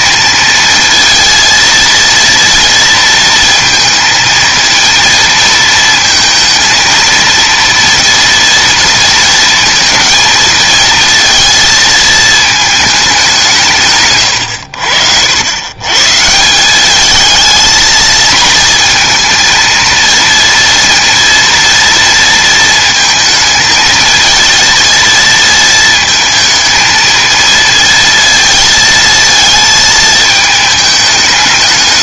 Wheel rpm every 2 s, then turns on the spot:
230, 230, 230, 230, 230, 230, 210, 80, 200, 230, 230, 230, 230, 220, 230, 210.
none